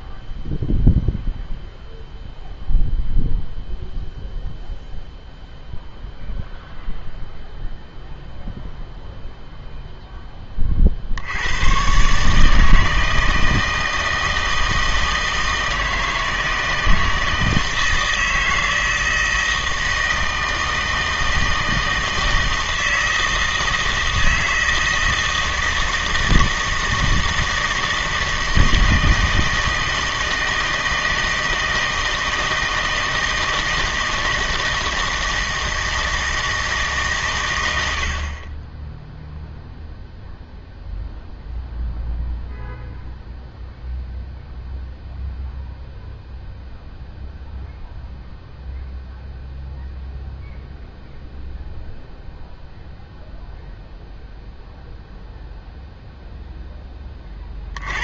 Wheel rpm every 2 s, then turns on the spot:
0, 0, 0, 0, 0, 30, 160, 160, 160, 160, 160, 160, 160, 160, 160, 160, 160, 160, 160, 20, 0, 0, 0, 0, 0, 0, 0, 0, 10.
none